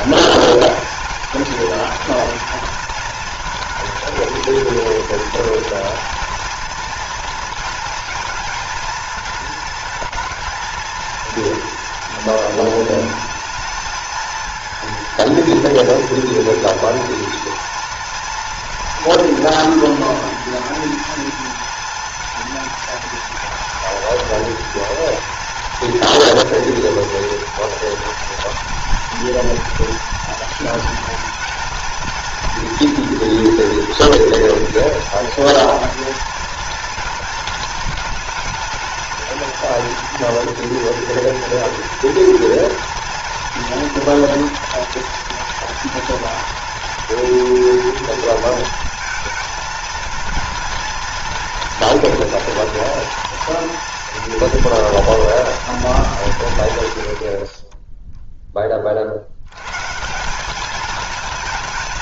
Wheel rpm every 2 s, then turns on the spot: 210, 220, 220, 230, 220, 230, 220, 220, 220, 230, 230, 220, 240, 230, 230, 230, 230, 230, 230, 220, 230, 230, 230, 240, 230, 230, 230, 230, 140, 30, 210.
none